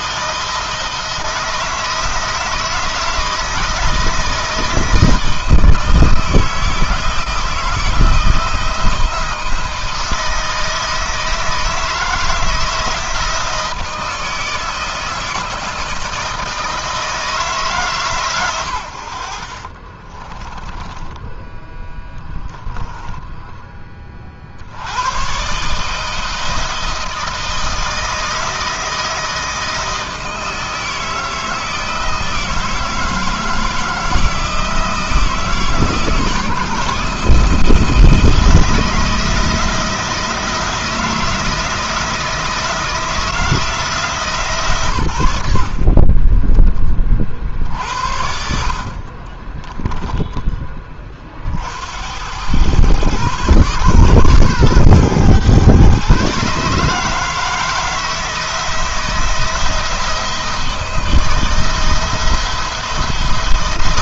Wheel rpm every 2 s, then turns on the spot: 170, 160, 160, 160, 160, 160, 160, 160, 160, 90, 20, 10, 80, 160, 160, 160, 160, 160, 160, 160, 160, 160, 120, 30, 50, 20, 110, 120, 150, 160, 170, 160.
22-24